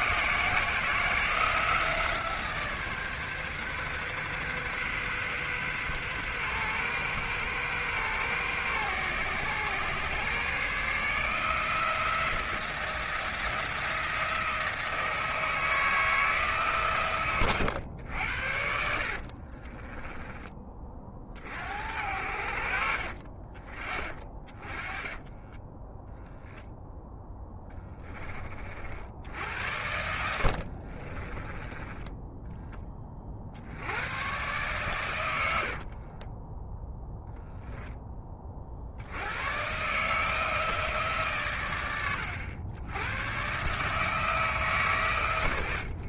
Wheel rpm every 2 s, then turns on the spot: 170, 150, 130, 130, 120, 150, 170, 160, 140, 60, 30, 50, 30, 10, 60, 40, 20, 110, 10, 60, 150, 100, 130.
18-20 24-26 30-32